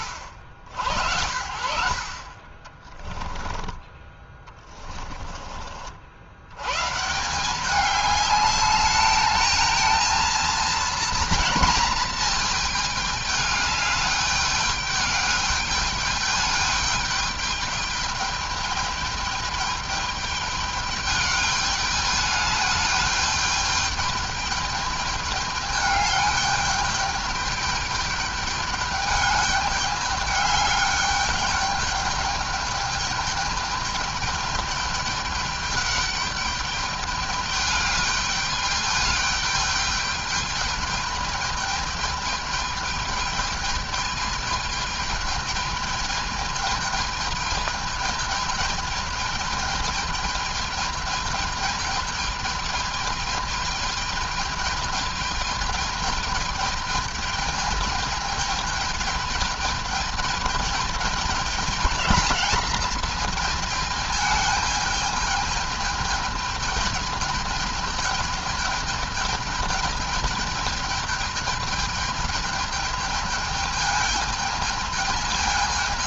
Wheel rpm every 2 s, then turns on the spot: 80, 20, 20, 130, 210, 230, 220, 210, 210, 210, 210, 210, 210, 210, 210, 210, 210, 210, 210, 210, 210, 210, 220, 210, 220, 210, 210, 220, 220, 210, 210, 210, 210, 210, 220, 210, 210, 220.
4-6